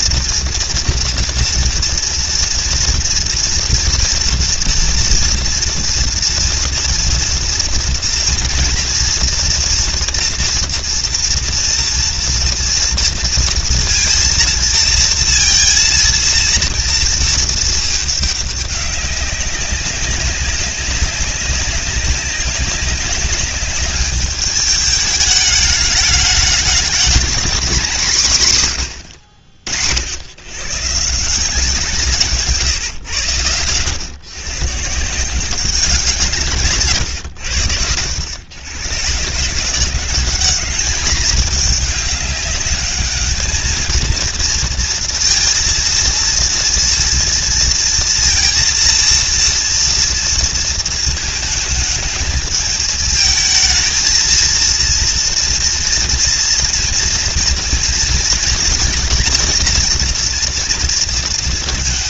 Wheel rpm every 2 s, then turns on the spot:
230, 230, 240, 230, 230, 230, 240, 230, 230, 200, 200, 190, 200, 210, 130, 120, 150, 150, 150, 110, 200, 210, 220, 230, 230, 230, 220, 230, 240, 230, 230.
none